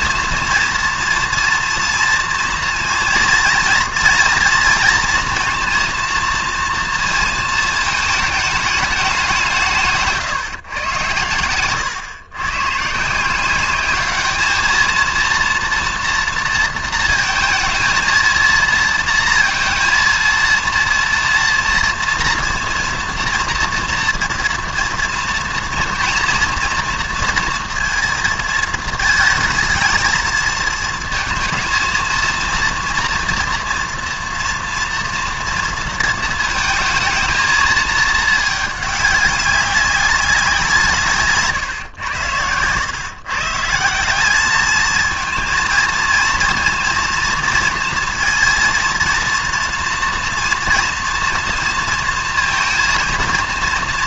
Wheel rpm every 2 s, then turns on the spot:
230, 230, 230, 230, 210, 110, 140, 220, 230, 230, 230, 240, 230, 230, 220, 220, 230, 230, 220, 210, 160, 120, 220, 230, 230, 240, 230.
none